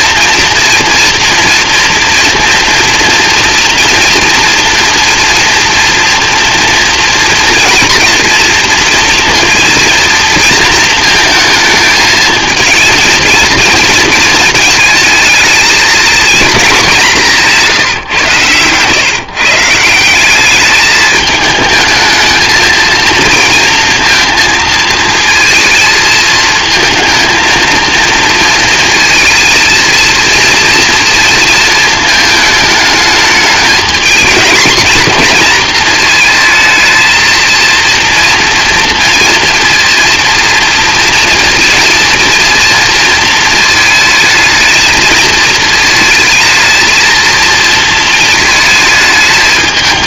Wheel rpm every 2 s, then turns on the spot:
230, 230, 230, 230, 230, 230, 230, 220, 210, 130, 210, 230, 230, 220, 230, 230, 210, 230, 220, 230, 230, 230, 220, 230, 220.
none